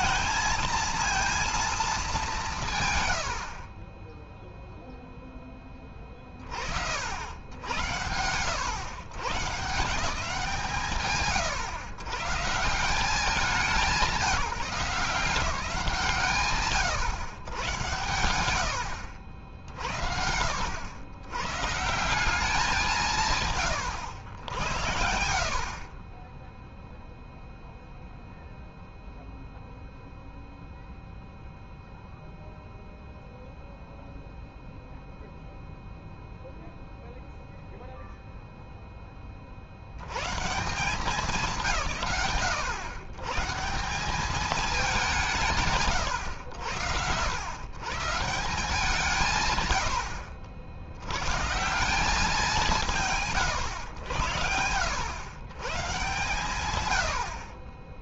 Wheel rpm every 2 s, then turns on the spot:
230, 80, 10, 80, 140, 120, 200, 180, 110, 60, 110, 150, 60, 0, 0, 0, 0, 0, 0, 20, 170, 120, 170, 90, 150, 90, 170, 90, 100.
none